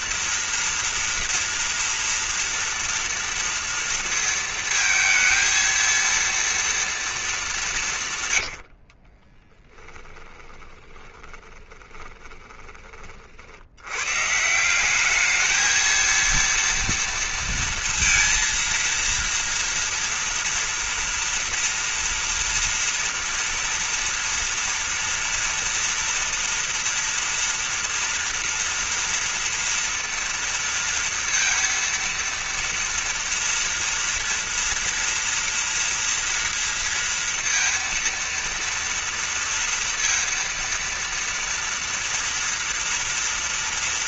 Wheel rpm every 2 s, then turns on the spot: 230, 230, 230, 230, 140, 10, 20, 130, 230, 230, 230, 230, 230, 230, 230, 230, 230, 230, 230, 230, 230, 230.
8-14